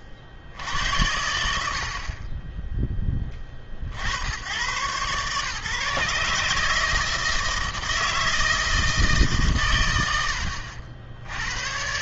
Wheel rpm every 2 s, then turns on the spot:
50, 20, 120, 150, 160, 80.
none